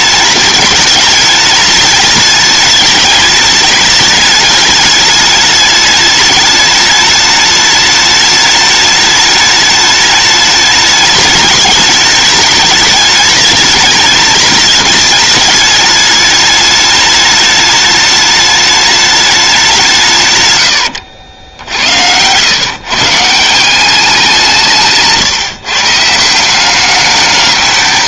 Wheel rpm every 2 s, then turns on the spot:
210, 210, 210, 210, 210, 210, 210, 210, 210, 210, 100, 130, 160, 200.
none